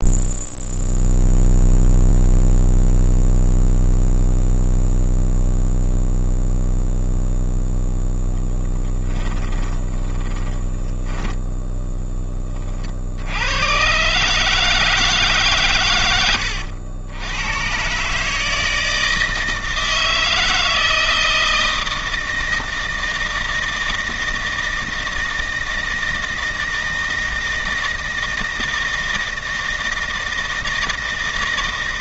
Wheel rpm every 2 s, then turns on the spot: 0, 0, 0, 0, 0, 10, 20, 160, 90, 160, 160, 160, 160, 160, 160, 160.
10-12